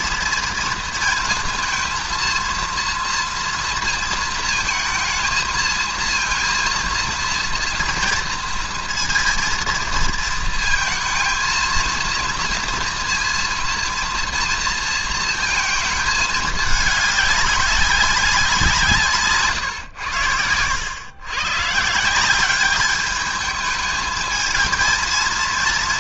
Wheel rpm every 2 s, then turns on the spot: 220, 230, 230, 230, 230, 220, 230, 230, 210, 170, 90, 200, 220.
none